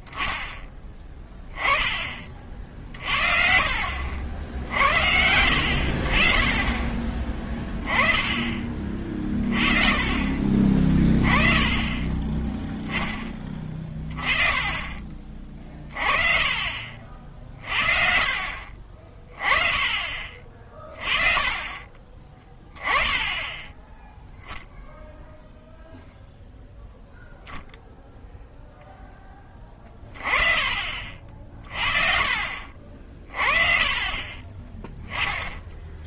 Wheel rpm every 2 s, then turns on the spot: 10, 50, 70, 30, 30, 30, 10, 20, 40, 40, 30, 10, 0, 0, 0, 40, 40, 20.
none